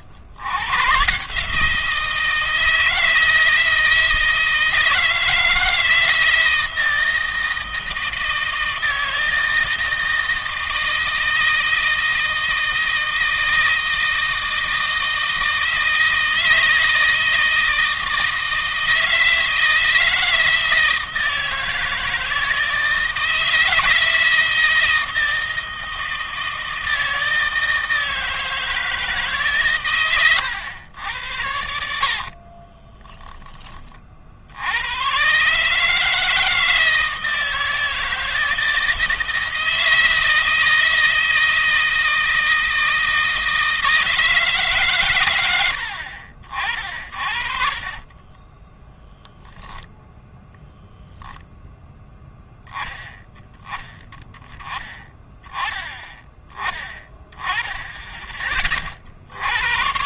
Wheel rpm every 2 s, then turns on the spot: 130, 160, 160, 170, 160, 160, 160, 160, 160, 160, 160, 160, 160, 160, 160, 100, 20, 110, 160, 160, 160, 160, 120, 50, 0, 0, 10, 10, 10, 50.
32-34 46-48